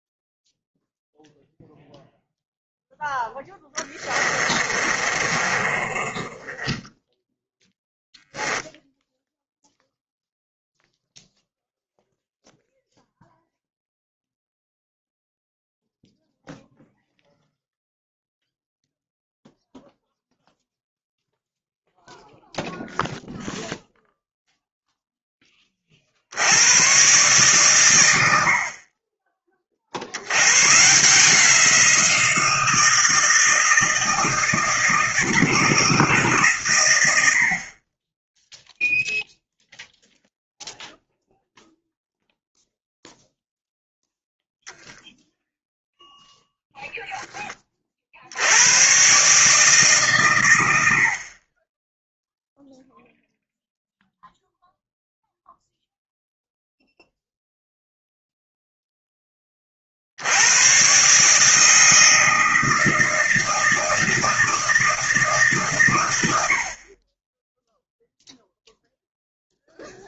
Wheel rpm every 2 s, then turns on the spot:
0, 0, 20, 20, 0, 0, 0, 0, 0, 0, 0, 0, 0, 100, 50, 120, 160, 160, 130, 0, 0, 0, 0, 0, 100, 90, 0, 0, 0, 0, 110, 160, 160, 60, 0.
4-8